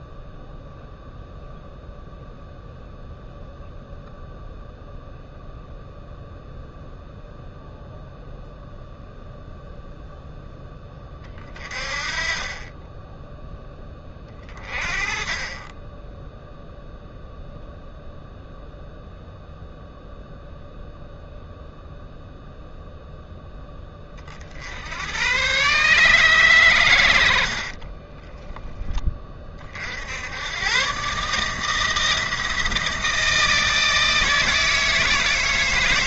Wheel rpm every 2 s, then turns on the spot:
0, 0, 0, 0, 0, 10, 20, 40, 0, 0, 0, 0, 70, 120, 10, 110, 160, 160.
none